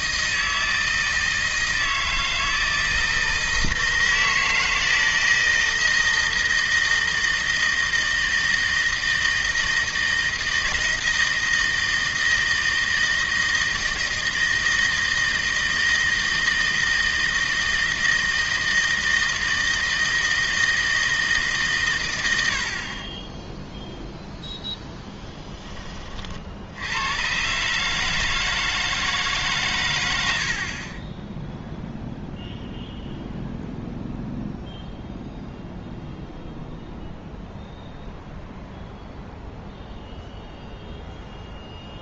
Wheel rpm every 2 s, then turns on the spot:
160, 160, 160, 160, 160, 160, 160, 160, 160, 160, 160, 60, 10, 70, 160, 40, 0, 0, 0, 0, 0.
none